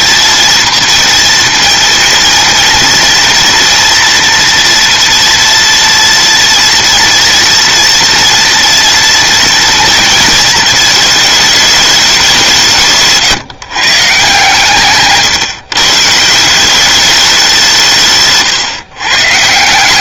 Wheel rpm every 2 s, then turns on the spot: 230, 230, 240, 230, 230, 230, 210, 140, 130, 180.
none